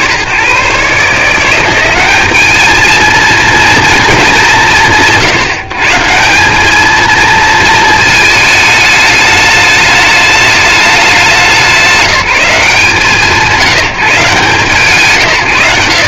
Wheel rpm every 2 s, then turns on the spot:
120, 210, 150, 190, 220, 210, 170, 150.
none